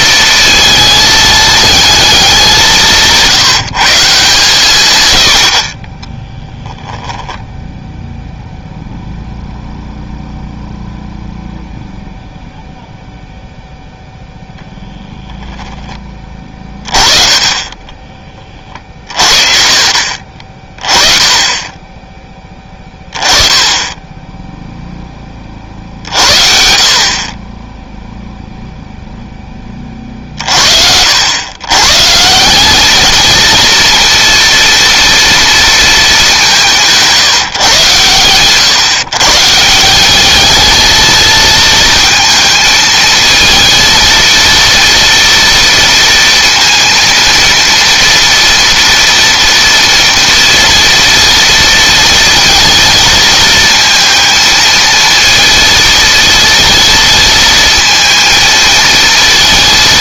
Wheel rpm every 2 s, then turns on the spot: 220, 180, 120, 10, 0, 0, 0, 0, 20, 40, 30, 20, 0, 50, 0, 80, 210, 240, 170, 130, 220, 220, 230, 230, 240, 230, 230, 220, 230, 230.
6-8